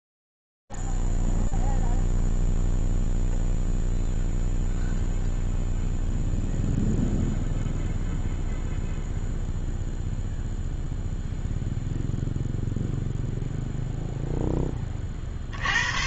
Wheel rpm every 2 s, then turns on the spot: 0, 0, 0, 0, 0, 0, 0, 0.
none